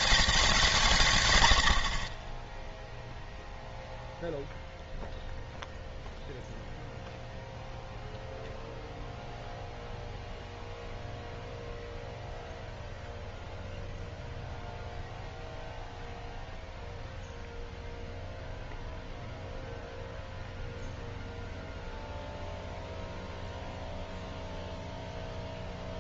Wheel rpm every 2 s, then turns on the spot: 180, 0, 0, 0, 0, 0, 0, 0, 0, 0, 0, 0, 0.
none